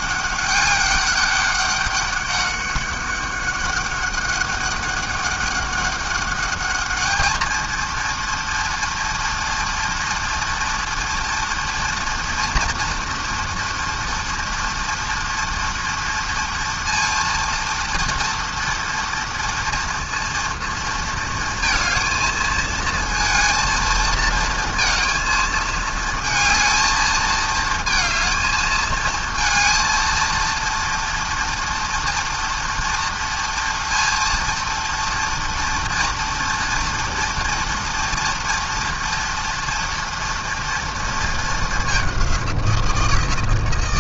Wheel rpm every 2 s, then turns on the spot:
200, 190, 200, 210, 230, 230, 240, 230, 230, 230, 230, 220, 230, 220, 220, 230, 230, 230, 240, 230, 230, 170.
none